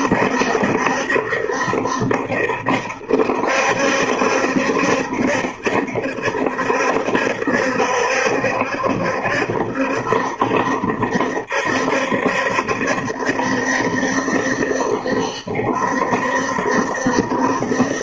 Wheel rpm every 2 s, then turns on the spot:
70, 70, 70, 70, 70, 70, 70, 70, 70.
none